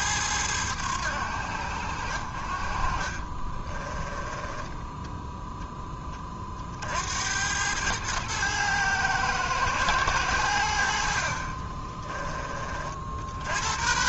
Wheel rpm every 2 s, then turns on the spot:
90, 50, 10, 50, 110, 80, 30.
none